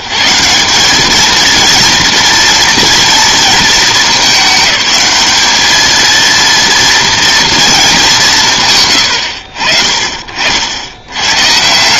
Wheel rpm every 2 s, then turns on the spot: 200, 240, 210, 230, 180, 80.
none